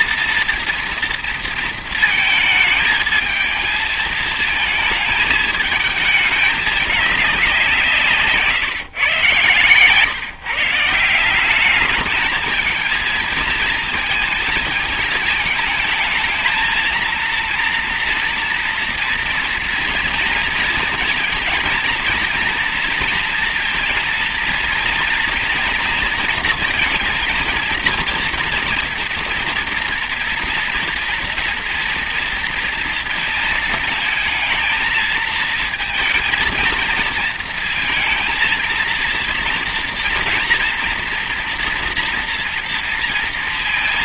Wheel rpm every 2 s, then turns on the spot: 230, 220, 220, 200, 140, 160, 220, 220, 230, 230, 230, 230, 230, 230, 230, 230, 230, 230, 230, 230, 230, 230.
none